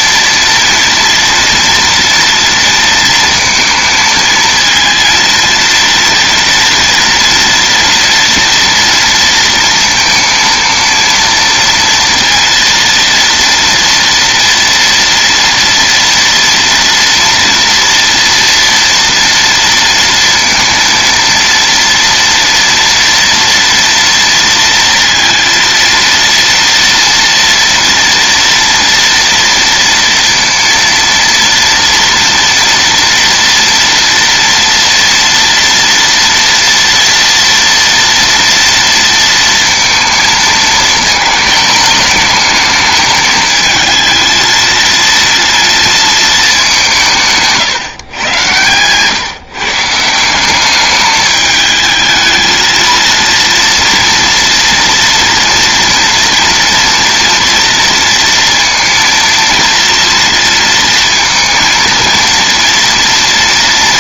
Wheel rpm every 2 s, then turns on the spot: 230, 230, 220, 230, 240, 230, 230, 230, 230, 230, 230, 230, 230, 230, 230, 230, 230, 230, 230, 230, 230, 210, 220, 220, 120, 170, 220, 230, 230, 230, 230, 230.
none